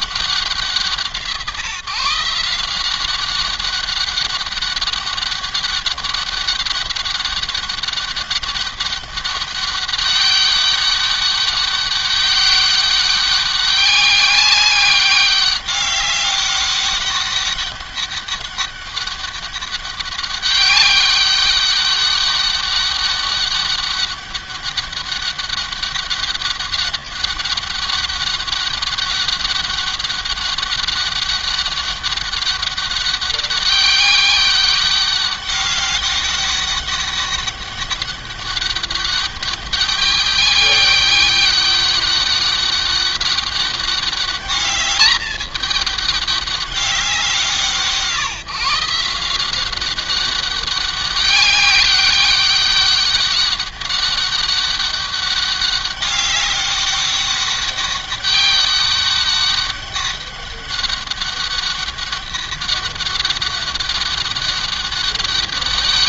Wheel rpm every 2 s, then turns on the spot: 170, 180, 200, 200, 190, 200, 200, 200, 200, 200, 200, 200, 200, 200, 200, 200, 200, 200, 200, 200, 200, 200, 210, 180, 180, 200, 190, 200, 200, 200, 200, 200, 200.
none